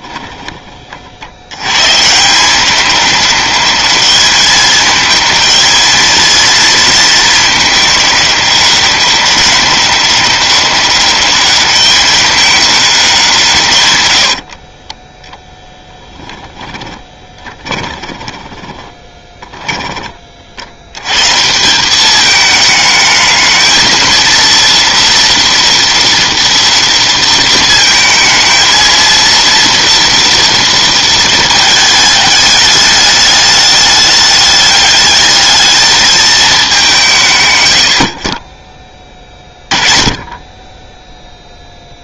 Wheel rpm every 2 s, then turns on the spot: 20, 170, 210, 220, 200, 200, 210, 40, 10, 20, 50, 210, 230, 230, 230, 230, 210, 210, 210, 30, 10.
0-2 14-20